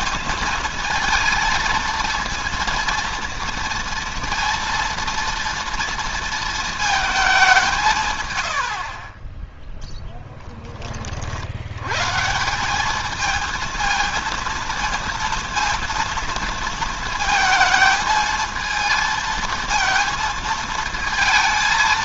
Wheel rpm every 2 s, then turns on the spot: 220, 230, 230, 230, 100, 10, 180, 230, 230, 220, 220.
none